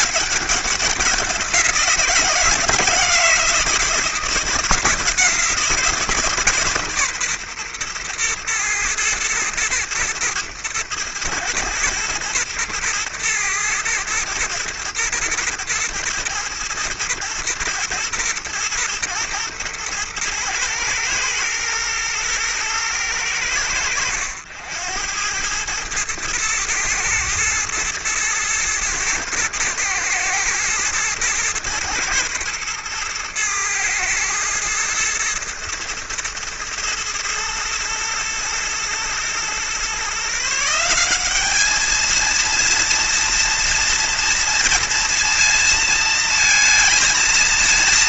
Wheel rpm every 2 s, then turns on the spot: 200, 170, 170, 140, 110, 110, 120, 120, 110, 120, 110, 110, 90, 110, 120, 120, 110, 110, 110, 120, 170, 230, 230, 230.
none